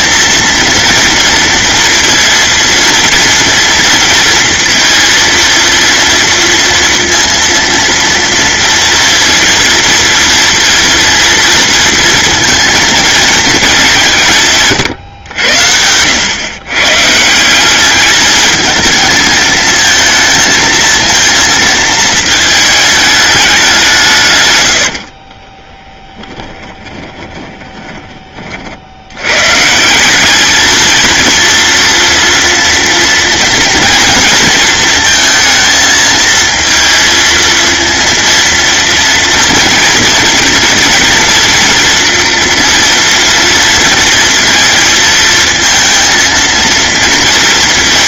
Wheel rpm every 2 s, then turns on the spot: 230, 230, 230, 230, 230, 230, 230, 130, 130, 220, 230, 210, 60, 20, 70, 220, 230, 220, 230, 230, 230, 230, 220, 230.
24-28